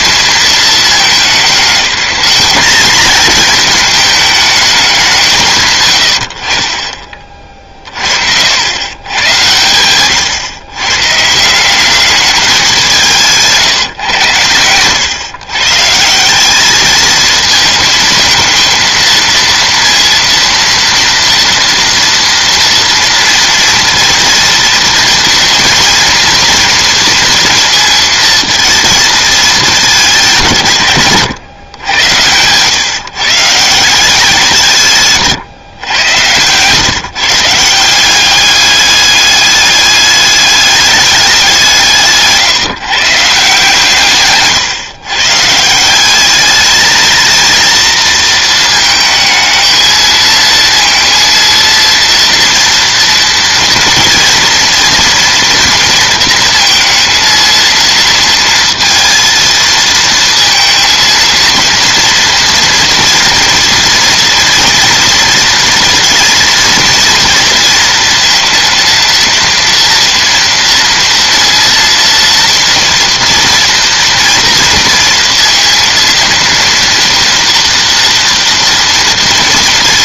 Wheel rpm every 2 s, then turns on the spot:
220, 210, 200, 50, 90, 130, 190, 110, 200, 230, 230, 230, 220, 230, 220, 150, 140, 170, 130, 200, 210, 150, 130, 210, 220, 230, 230, 230, 220, 230, 230, 230, 230, 220, 230, 230, 230, 230, 230, 230.
none